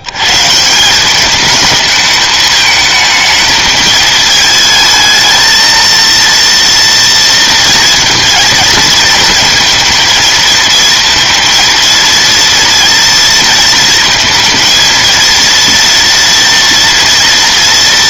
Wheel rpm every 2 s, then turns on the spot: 170, 220, 220, 230, 220, 230, 230, 230, 230.
none